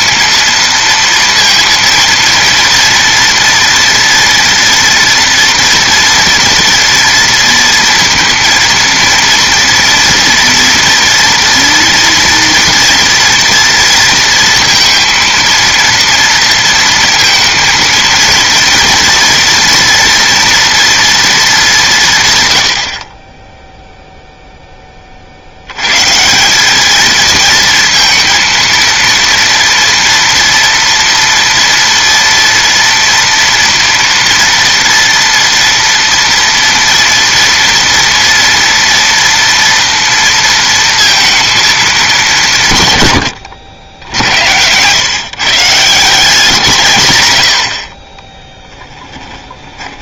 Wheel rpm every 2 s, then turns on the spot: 230, 230, 230, 230, 230, 230, 240, 230, 230, 230, 230, 150, 0, 170, 230, 230, 230, 230, 230, 230, 230, 180, 80, 160, 10.
48-50